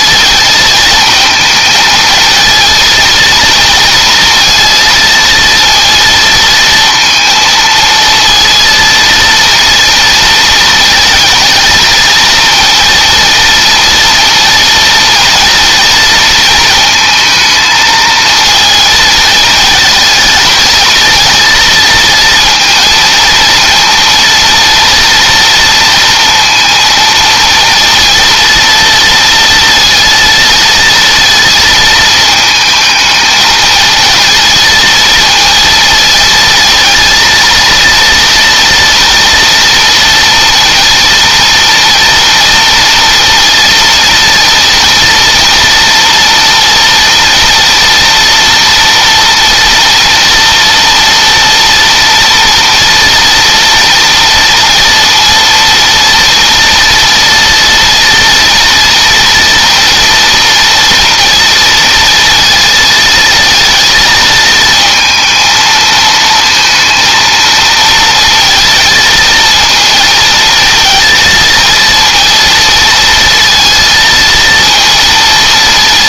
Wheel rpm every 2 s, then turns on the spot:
220, 230, 230, 230, 230, 230, 230, 230, 220, 220, 230, 230, 230, 230, 230, 230, 220, 230, 230, 230, 240, 230, 230, 230, 240, 230, 240, 230, 230, 230, 230, 230, 230, 230, 230, 220, 230, 230.
none